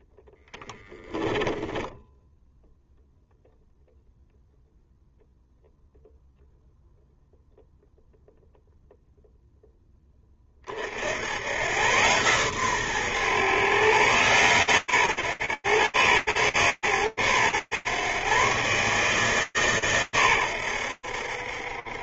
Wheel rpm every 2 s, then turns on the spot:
10, 0, 0, 0, 10, 110, 130, 120, 120, 150, 60.
0-2